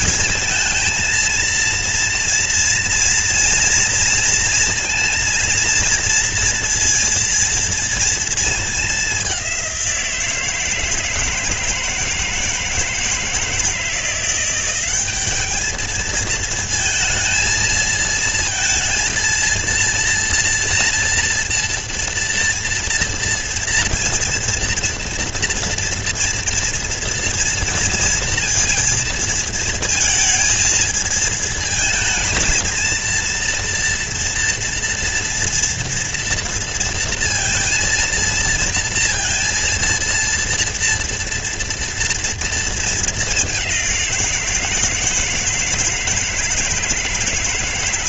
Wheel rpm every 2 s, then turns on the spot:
230, 230, 230, 230, 230, 170, 160, 170, 220, 230, 230, 230, 230, 230, 230, 230, 220, 230, 230, 230, 230, 230, 190, 160.
none